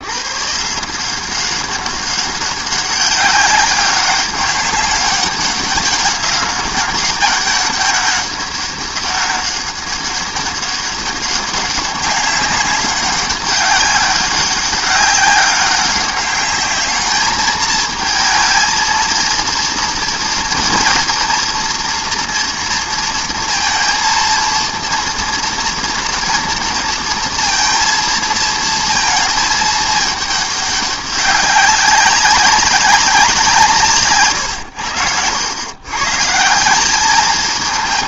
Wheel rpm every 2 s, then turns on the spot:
150, 200, 200, 200, 200, 200, 200, 190, 200, 220, 240, 230, 230, 230, 230, 200, 190, 100, 180.
none